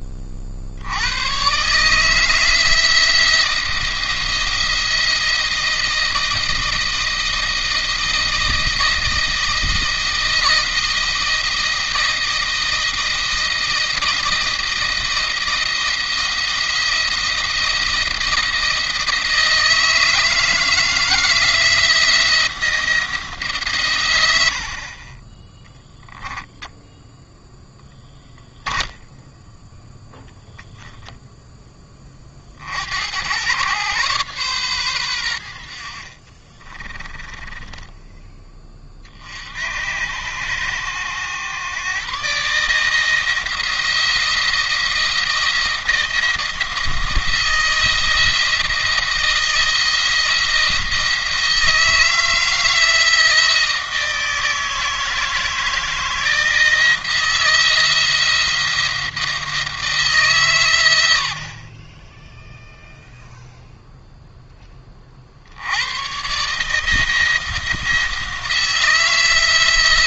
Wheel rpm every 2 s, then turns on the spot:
70, 160, 170, 160, 170, 160, 160, 170, 170, 160, 160, 170, 40, 10, 0, 10, 70, 120, 20, 20, 100, 150, 170, 170, 170, 160, 160, 160, 160, 170, 120, 0, 20, 150, 160.
24-28 30-32 36-38